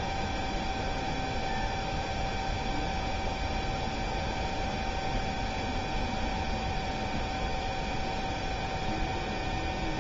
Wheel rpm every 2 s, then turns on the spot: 0, 0, 0, 0, 0.
none